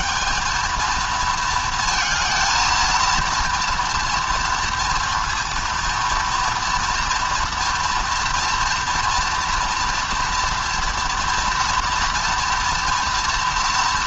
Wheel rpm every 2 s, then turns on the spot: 230, 230, 230, 240, 230, 230, 230.
none